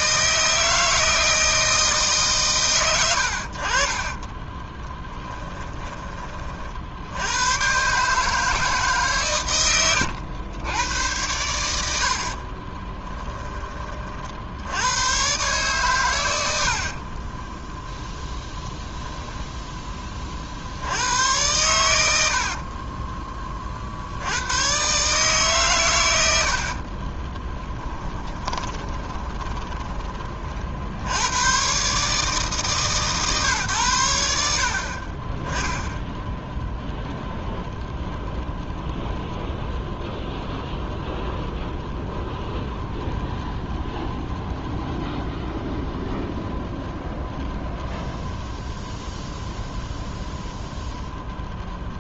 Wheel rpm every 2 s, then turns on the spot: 160, 110, 10, 70, 140, 90, 30, 90, 50, 0, 80, 30, 130, 60, 20, 70, 140, 50, 0, 0, 0, 0, 0, 0, 0, 0.
4-6 12-14 22-24 26-30